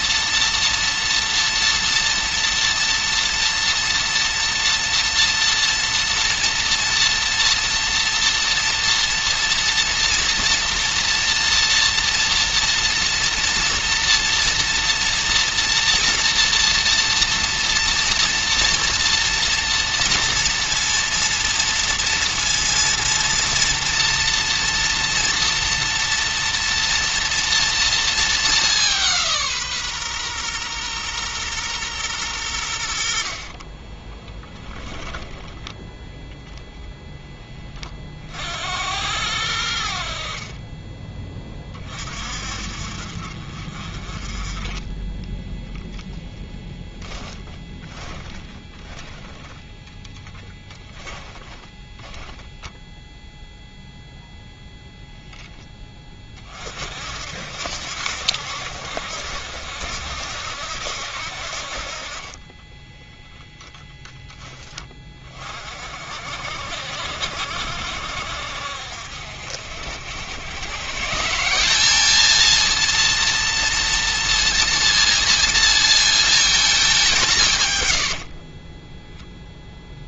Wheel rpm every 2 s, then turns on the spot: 230, 230, 230, 230, 230, 230, 240, 230, 230, 230, 230, 230, 230, 230, 180, 120, 70, 20, 0, 80, 20, 50, 10, 10, 10, 10, 0, 0, 50, 70, 70, 10, 20, 60, 60, 140, 230, 230, 190, 10.
44-46 50-52 62-64